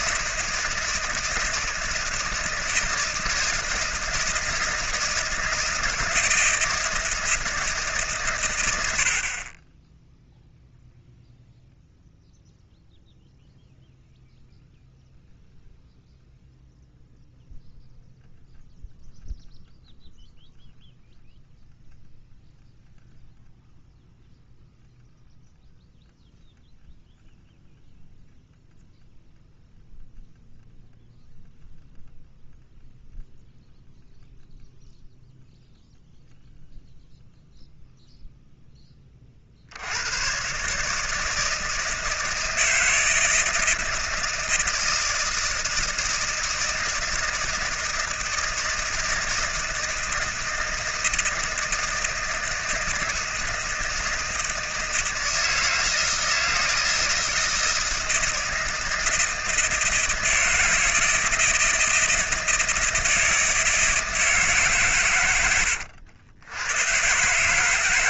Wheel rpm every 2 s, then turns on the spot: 160, 160, 160, 160, 90, 0, 0, 0, 0, 0, 0, 0, 0, 0, 0, 0, 0, 0, 0, 10, 140, 160, 160, 160, 160, 160, 160, 160, 160, 160, 160, 160, 140, 110.
none